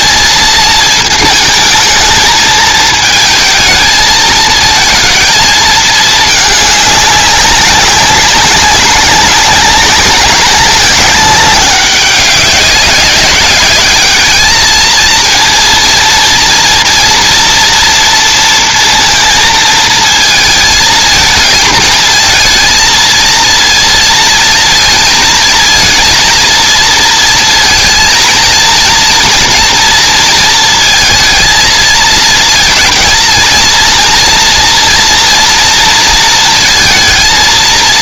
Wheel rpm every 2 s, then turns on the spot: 220, 220, 220, 210, 200, 200, 190, 220, 240, 230, 220, 230, 230, 230, 230, 230, 220, 230, 230.
none